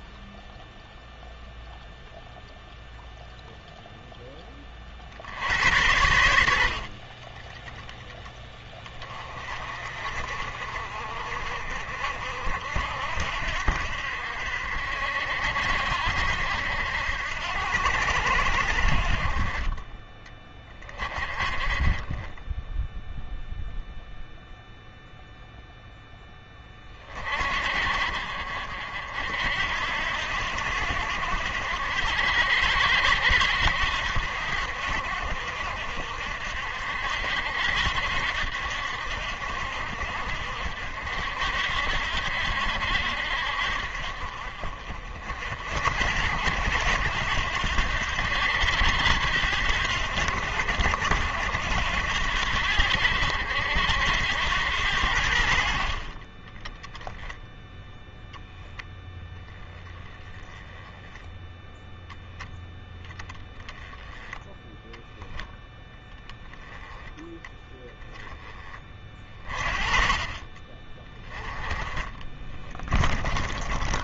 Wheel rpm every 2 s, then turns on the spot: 0, 0, 30, 50, 30, 40, 60, 60, 70, 60, 30, 0, 0, 30, 60, 70, 80, 60, 60, 70, 60, 70, 50, 80, 80, 70, 80, 90, 20, 0, 10, 10, 0, 10, 20, 20, 20.
72-74